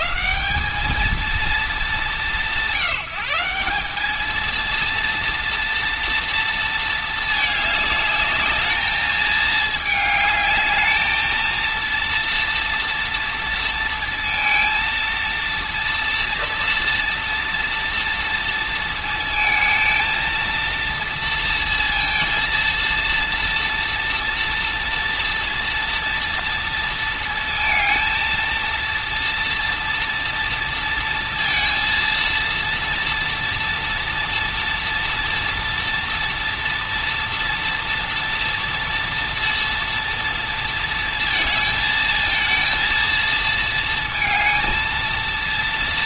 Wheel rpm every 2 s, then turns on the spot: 200, 190, 230, 230, 210, 210, 230, 230, 230, 230, 230, 230, 230, 230, 230, 230, 230, 240, 240, 230, 230, 230, 220.
none